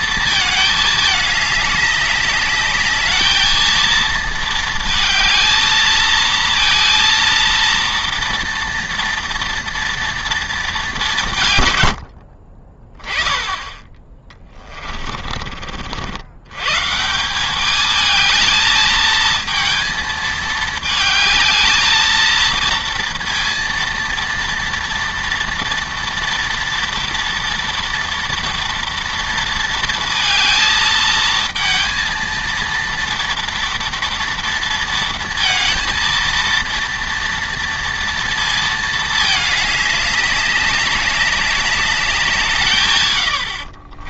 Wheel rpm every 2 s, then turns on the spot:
220, 210, 220, 230, 230, 210, 30, 30, 120, 220, 220, 230, 230, 230, 230, 220, 230, 230, 230, 220, 200, 140.
14-16